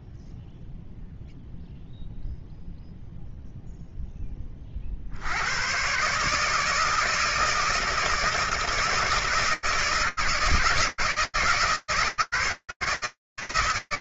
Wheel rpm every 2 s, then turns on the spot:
0, 0, 80, 160, 160, 160, 140.
none